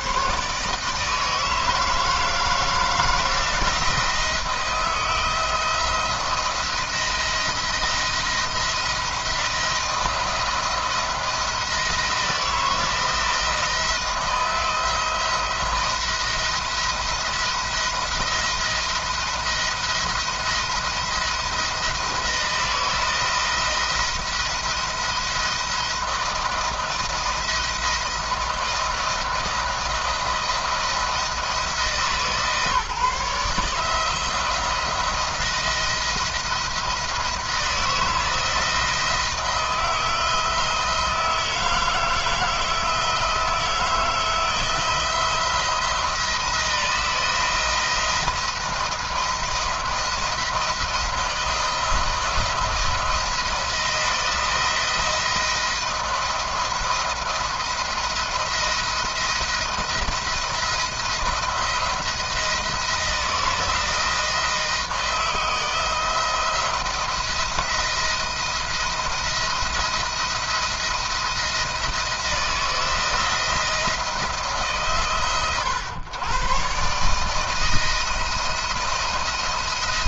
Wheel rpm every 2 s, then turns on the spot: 140, 160, 160, 170, 170, 170, 160, 170, 160, 170, 170, 160, 170, 170, 170, 170, 160, 170, 170, 160, 160, 160, 160, 170, 170, 160, 170, 170, 170, 170, 170, 160, 160, 160, 170, 170, 170, 150, 130, 170.
none